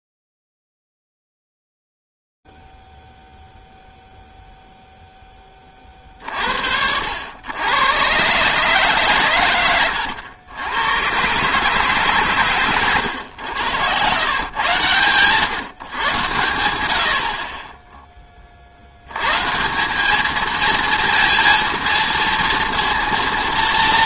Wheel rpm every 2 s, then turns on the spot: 0, 0, 0, 40, 120, 100, 150, 110, 120, 30, 210, 230.
none